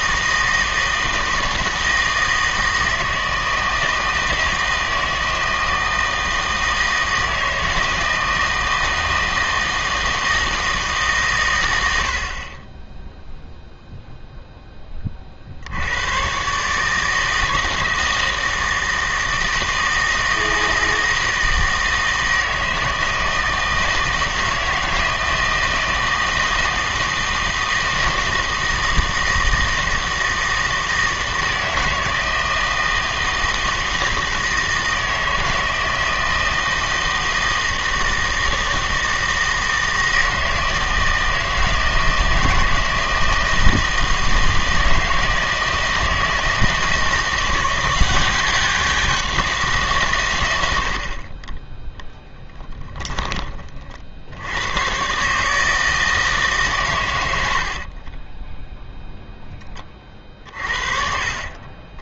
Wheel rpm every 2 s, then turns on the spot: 160, 160, 160, 160, 160, 160, 30, 10, 150, 160, 160, 160, 160, 160, 160, 160, 160, 160, 160, 160, 160, 160, 160, 160, 190, 80, 20, 100, 130, 0, 40.
52-54 60-62